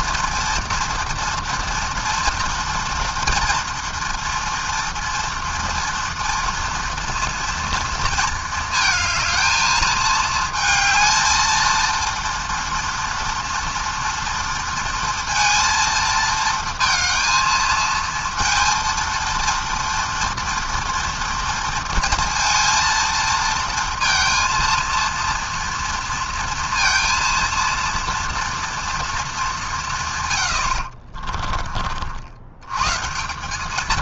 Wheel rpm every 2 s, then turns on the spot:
230, 230, 230, 230, 220, 220, 230, 230, 230, 230, 230, 220, 230, 230, 210, 50, 180.
30-32